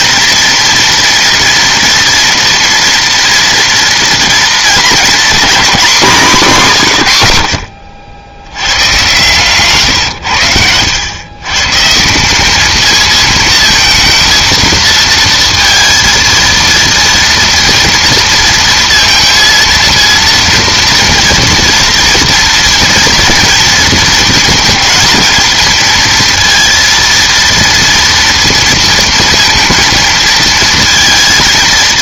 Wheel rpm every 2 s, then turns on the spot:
240, 240, 240, 170, 100, 90, 210, 230, 230, 230, 230, 230, 220, 230, 230, 230.
none